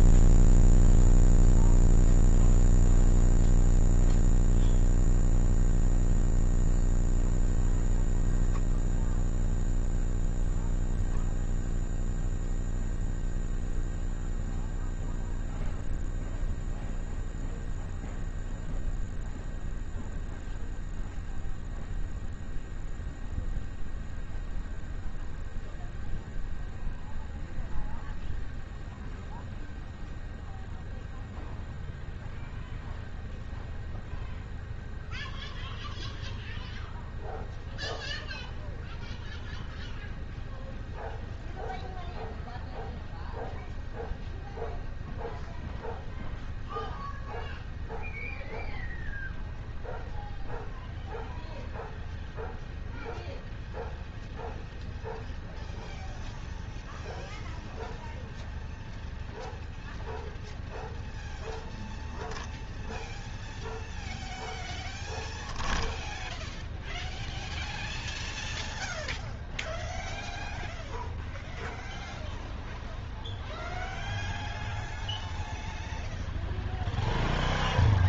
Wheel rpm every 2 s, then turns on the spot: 0, 0, 0, 0, 0, 0, 0, 0, 0, 0, 0, 0, 0, 0, 0, 0, 0, 0, 0, 0, 0, 0, 0, 0, 0, 0, 0, 0, 0, 0, 0, 0, 0, 0, 0, 0, 0, 0, 0.
none